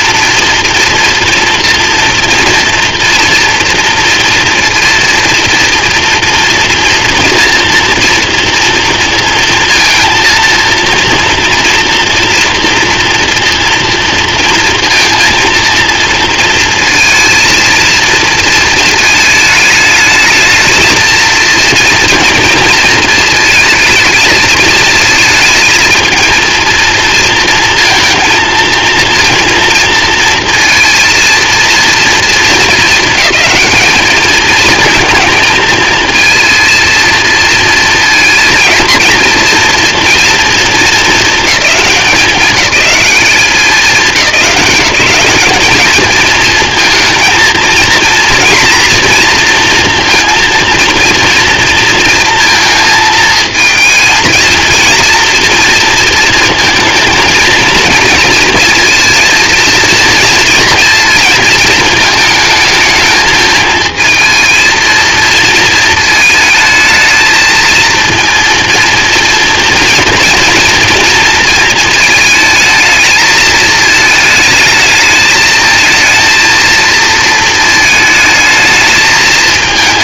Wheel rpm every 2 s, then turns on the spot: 230, 230, 230, 240, 230, 230, 230, 230, 230, 230, 220, 230, 220, 230, 230, 230, 230, 220, 220, 220, 220, 200, 190, 220, 240, 230, 230, 230, 230, 230, 230, 220, 230, 230, 230, 230, 220, 220, 230, 220.
none